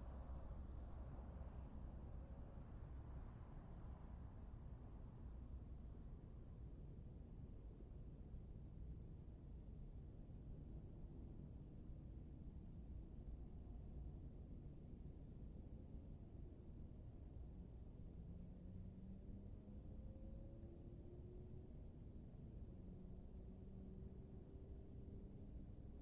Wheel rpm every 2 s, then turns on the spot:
0, 0, 0, 0, 0, 0, 0, 0, 0, 0, 0, 0, 0.
none